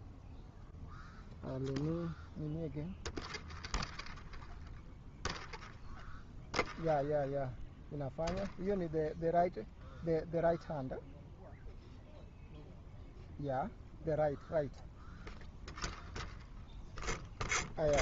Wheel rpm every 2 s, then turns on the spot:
0, 0, 0, 0, 0, 0, 0, 0, 0.
none